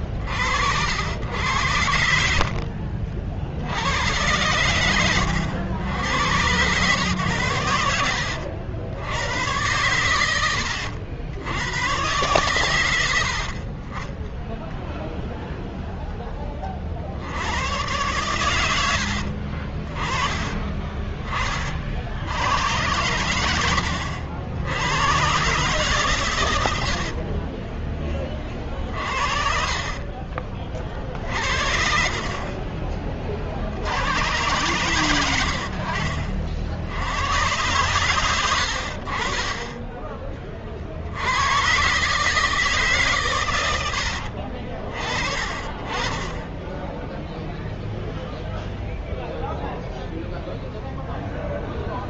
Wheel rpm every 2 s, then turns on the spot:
60, 60, 100, 100, 80, 100, 120, 10, 20, 100, 20, 80, 70, 110, 40, 40, 40, 100, 50, 90, 30, 150, 50, 20, 0, 0.
2-4 20-22